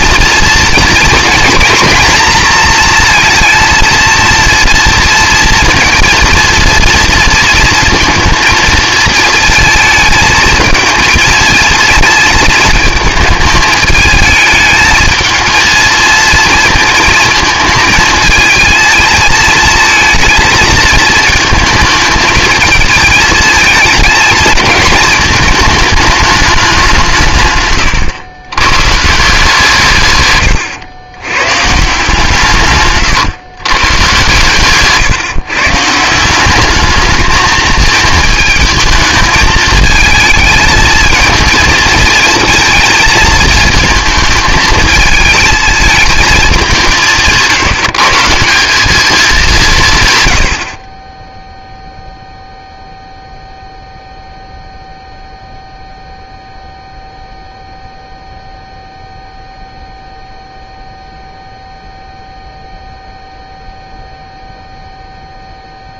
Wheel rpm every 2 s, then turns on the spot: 230, 230, 230, 230, 230, 220, 220, 220, 230, 220, 220, 220, 220, 190, 130, 110, 140, 140, 210, 220, 220, 230, 220, 190, 190, 50, 0, 0, 0, 0, 0, 0, 0.
none